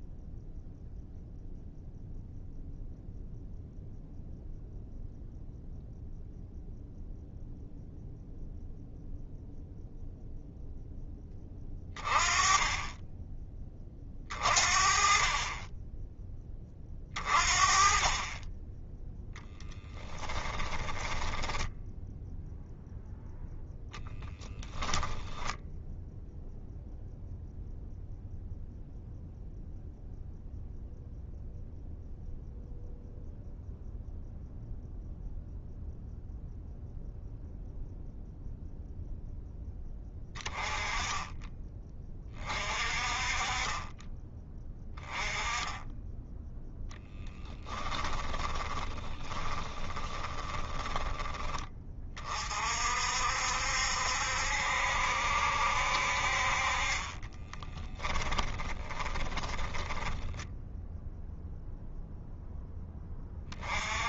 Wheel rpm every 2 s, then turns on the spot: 0, 0, 0, 0, 0, 0, 20, 40, 20, 20, 10, 0, 10, 0, 0, 0, 0, 0, 0, 0, 30, 30, 20, 10, 10, 20, 40, 70, 50, 20, 10, 0.
20-22 48-52 58-62